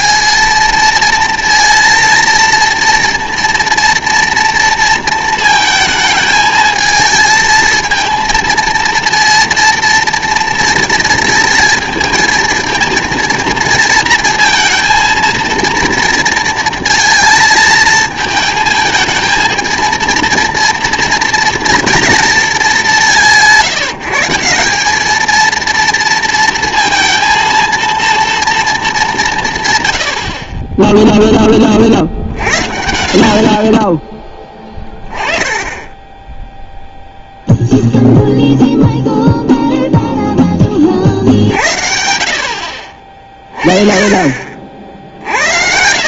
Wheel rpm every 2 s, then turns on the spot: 230, 230, 230, 220, 230, 230, 220, 230, 230, 220, 230, 210, 190, 230, 220, 20, 60, 20, 0, 0, 30, 50, 60.
none